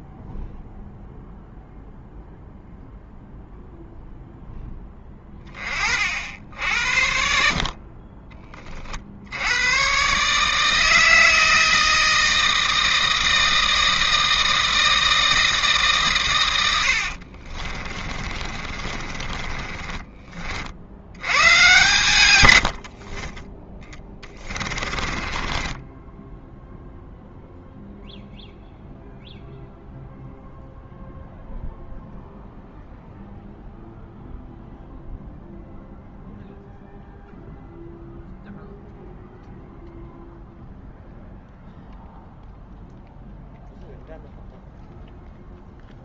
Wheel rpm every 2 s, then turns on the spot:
0, 0, 0, 70, 20, 150, 160, 160, 100, 30, 50, 90, 20, 10, 0, 0, 0, 0, 0, 0, 0, 0, 0.
18-20 24-28